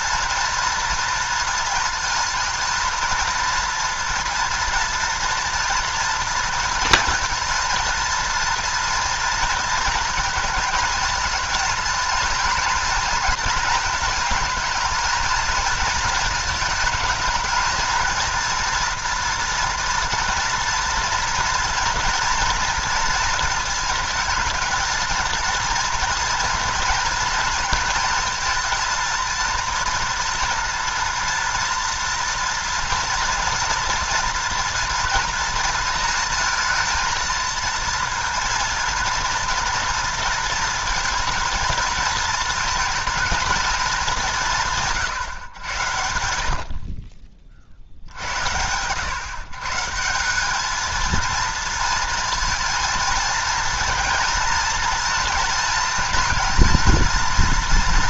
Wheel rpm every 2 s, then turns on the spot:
230, 230, 230, 220, 230, 220, 230, 230, 220, 230, 230, 230, 230, 230, 230, 230, 230, 230, 230, 230, 230, 220, 160, 60, 100, 210, 230, 230, 230.
none